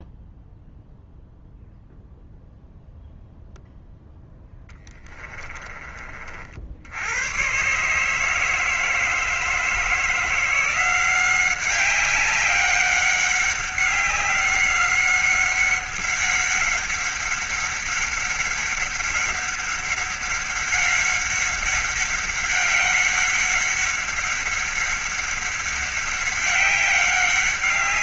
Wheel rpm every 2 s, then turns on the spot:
0, 0, 10, 70, 160, 170, 190, 190, 200, 190, 200, 200, 200, 190.
4-6